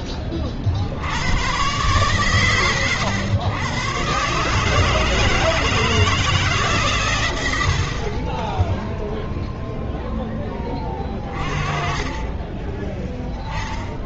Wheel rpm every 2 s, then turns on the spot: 30, 110, 140, 150, 10, 10, 20.
none